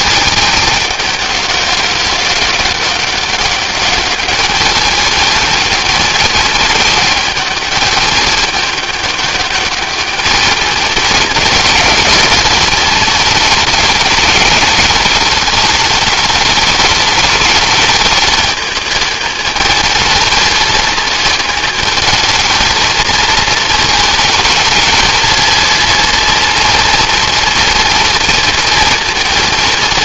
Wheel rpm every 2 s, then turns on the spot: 200, 200, 220, 210, 210, 210, 220, 210, 210, 220, 220, 220, 230, 230, 220.
none